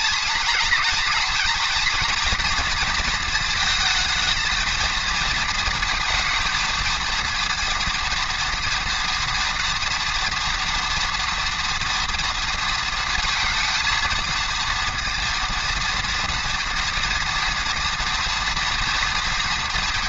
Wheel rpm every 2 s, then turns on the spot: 230, 240, 220, 220, 230, 230, 230, 230, 240, 230.
none